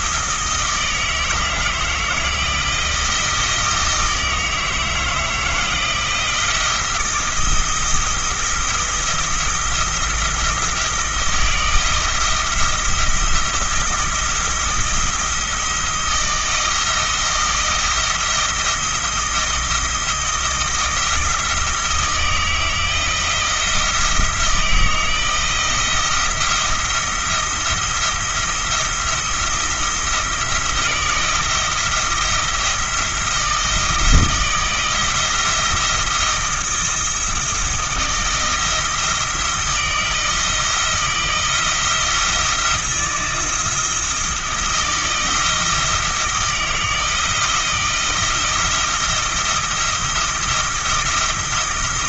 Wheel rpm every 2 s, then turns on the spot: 160, 170, 160, 170, 170, 170, 170, 170, 160, 160, 170, 160, 160, 170, 170, 160, 170, 170, 160, 160, 160, 170, 160, 160, 160, 170.
none